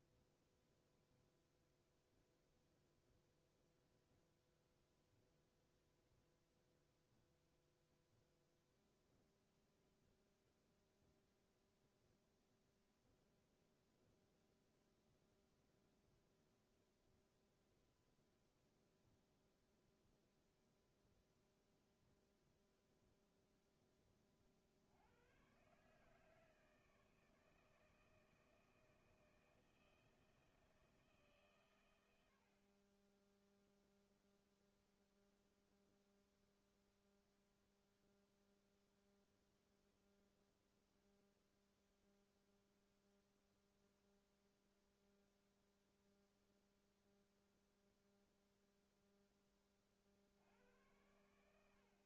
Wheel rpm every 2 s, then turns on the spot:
0, 0, 0, 0, 0, 0, 0, 0, 0, 0, 0, 0, 30, 150, 160, 160, 60, 0, 0, 0, 0, 0, 0, 0, 0, 70.
none